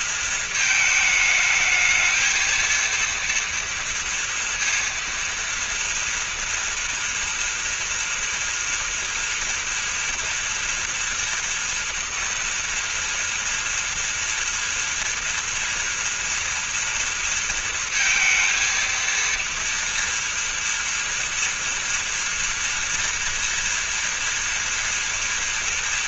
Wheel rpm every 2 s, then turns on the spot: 230, 220, 230, 230, 230, 240, 230, 230, 230, 230, 230, 230, 230.
none